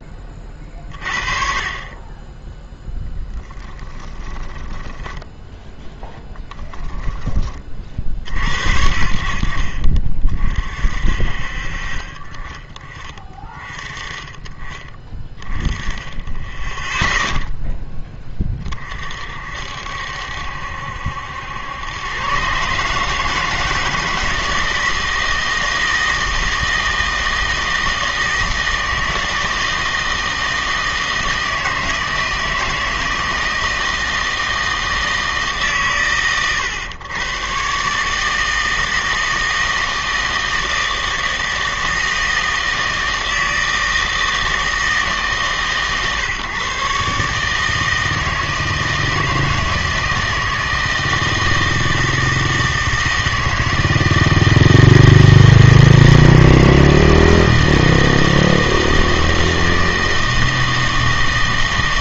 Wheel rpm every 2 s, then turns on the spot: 40, 10, 10, 0, 60, 40, 30, 30, 10, 50, 70, 140, 160, 160, 160, 160, 160, 160, 110, 160, 160, 160, 160, 130, 160, 160, 160, 160, 160, 160, 160.
4-6